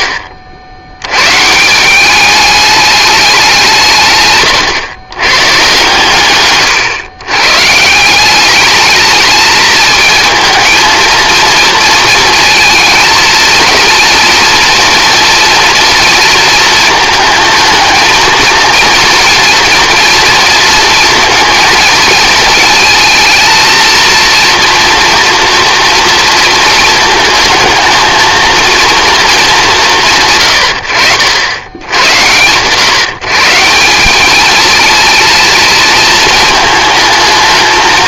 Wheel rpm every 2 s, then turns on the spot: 70, 210, 120, 130, 200, 220, 230, 240, 230, 230, 230, 220, 230, 230, 230, 100, 130, 220, 220.
4-6